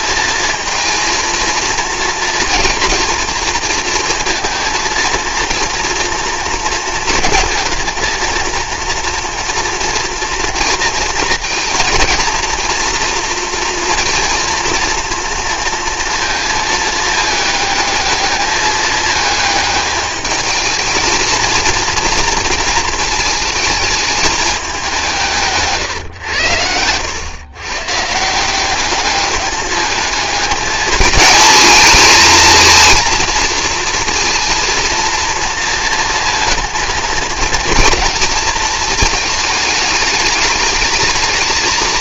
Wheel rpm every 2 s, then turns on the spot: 230, 230, 230, 230, 230, 230, 230, 240, 220, 210, 220, 230, 200, 100, 190, 220, 220, 230, 230, 220, 210.
none